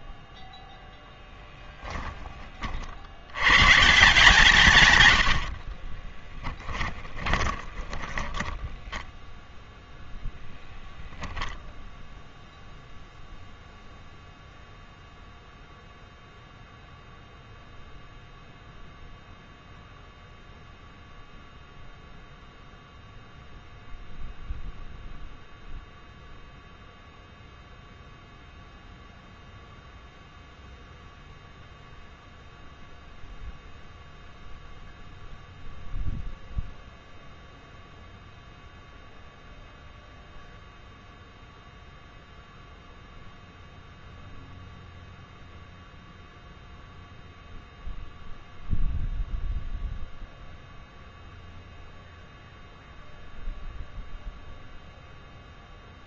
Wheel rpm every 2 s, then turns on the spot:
0, 40, 140, 20, 10, 0, 0, 0, 0, 0, 0, 0, 0, 0, 0, 0, 0, 0, 0, 0, 0, 0, 0, 0, 0, 0, 0, 0.
6-10